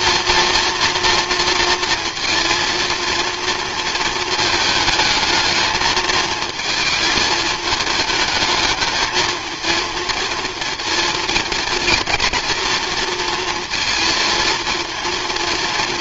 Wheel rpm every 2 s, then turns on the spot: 230, 230, 220, 220, 220, 230, 230, 230.
none